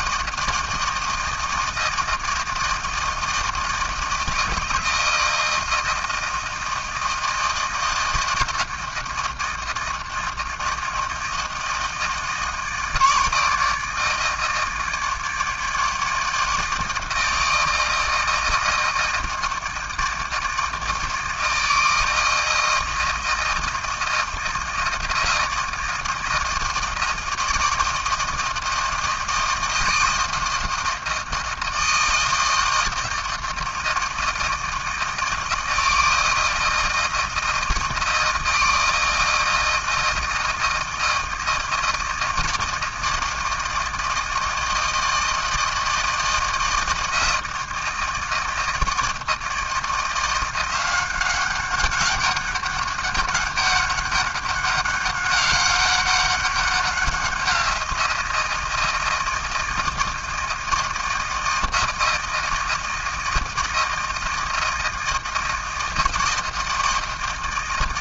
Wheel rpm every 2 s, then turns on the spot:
160, 160, 160, 160, 160, 160, 160, 160, 160, 160, 160, 160, 160, 160, 160, 160, 160, 160, 160, 160, 160, 160, 160, 160, 160, 190, 200, 200, 180, 160, 160, 160, 160, 160.
none